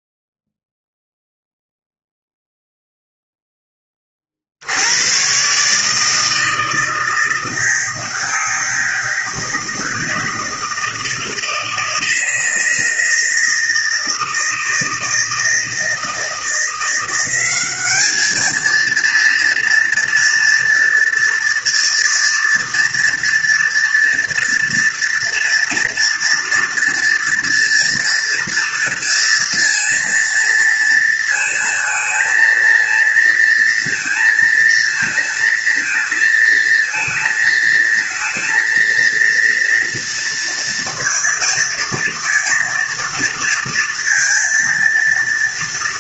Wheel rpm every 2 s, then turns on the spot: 0, 0, 90, 160, 160, 160, 160, 160, 180, 230, 230, 230, 230, 230, 230, 230, 230, 230, 220, 230, 230, 230, 230.
none